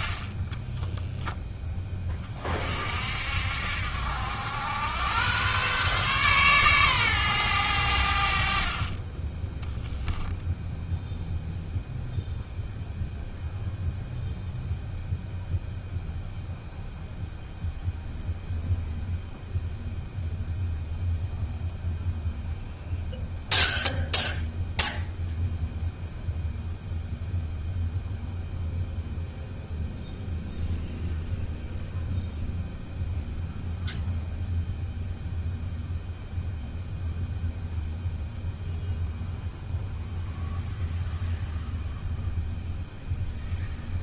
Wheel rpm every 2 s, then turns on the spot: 10, 50, 100, 130, 50, 0, 0, 0, 0, 0, 0, 0, 0, 0, 0, 0, 0, 0, 0, 0, 0, 0.
0-2